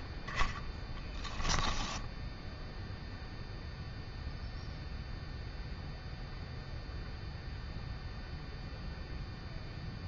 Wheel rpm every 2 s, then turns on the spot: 20, 0, 0, 0, 0.
none